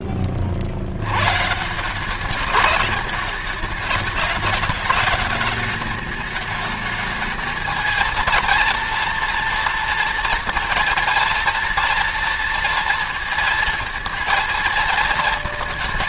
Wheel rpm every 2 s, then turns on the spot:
80, 200, 210, 210, 230, 230, 230, 230.
none